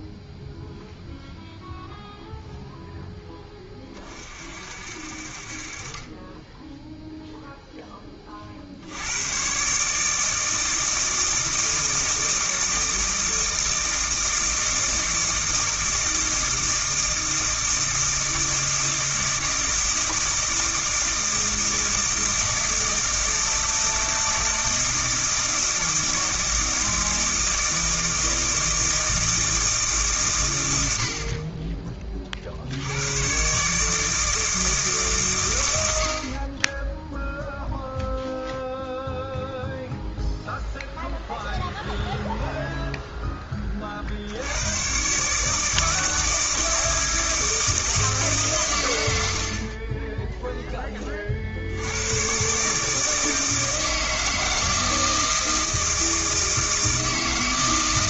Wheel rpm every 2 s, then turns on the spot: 0, 0, 50, 10, 60, 160, 160, 160, 160, 160, 160, 160, 160, 160, 160, 100, 70, 160, 30, 0, 0, 0, 100, 160, 120, 10, 140, 160, 160.
none